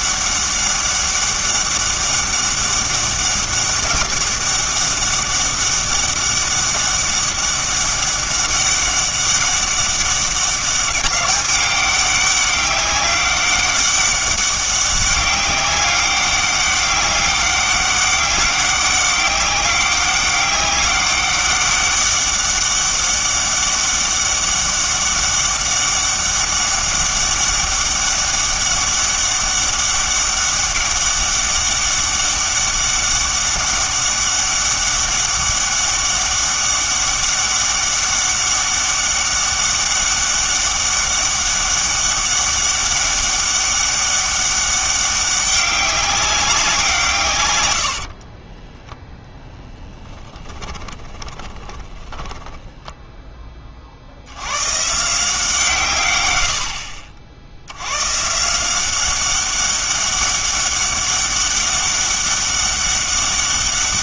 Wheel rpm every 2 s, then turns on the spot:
200, 200, 200, 200, 190, 200, 200, 200, 200, 200, 200, 200, 200, 200, 200, 200, 200, 200, 200, 200, 200, 200, 200, 180, 10, 20, 10, 130, 70, 180, 200, 200.
48-54